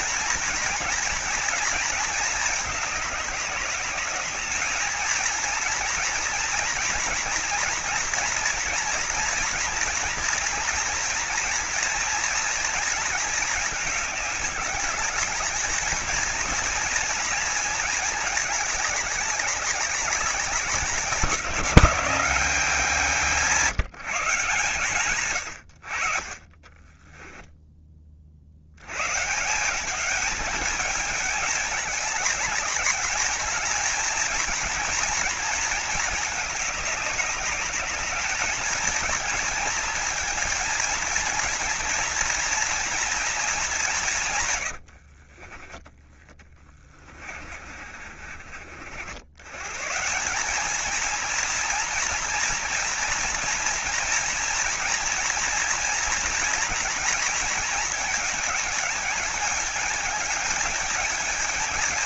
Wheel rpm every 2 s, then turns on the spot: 240, 200, 220, 240, 230, 230, 220, 200, 230, 200, 190, 180, 130, 10, 120, 200, 210, 230, 200, 230, 230, 230, 70, 30, 80, 230, 230, 230, 230, 210, 220.
26-28 44-48